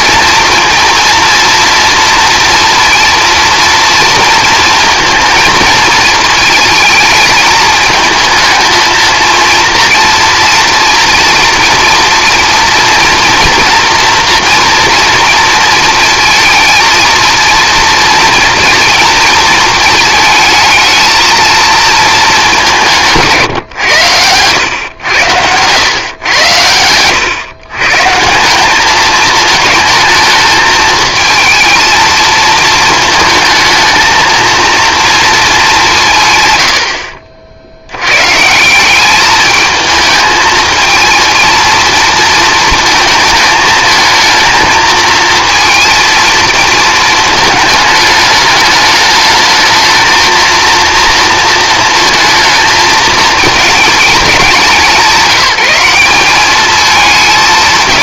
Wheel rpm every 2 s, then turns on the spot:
230, 230, 230, 220, 230, 230, 230, 230, 230, 240, 220, 180, 100, 100, 200, 220, 220, 230, 90, 170, 220, 220, 230, 220, 210, 230, 220, 190, 210.
26-28